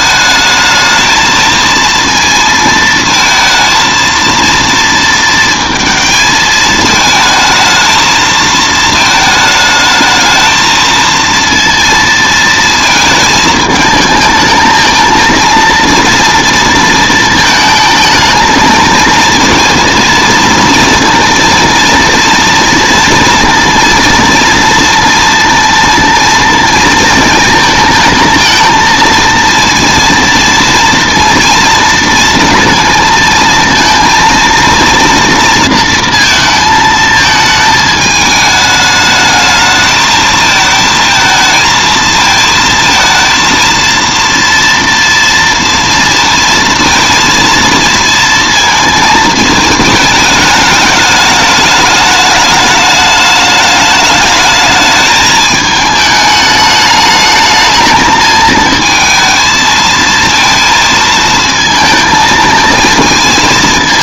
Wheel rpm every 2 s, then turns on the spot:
220, 230, 230, 220, 220, 220, 220, 220, 230, 220, 230, 230, 230, 230, 220, 230, 220, 230, 220, 210, 220, 220, 230, 230, 230, 210, 210, 210, 210, 220, 230, 220.
none